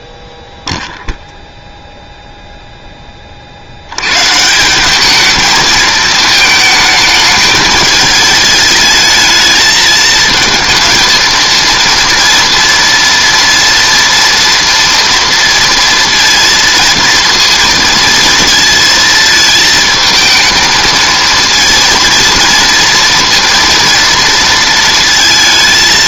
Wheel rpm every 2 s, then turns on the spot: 0, 0, 170, 220, 210, 220, 230, 230, 230, 230, 220, 230, 230.
none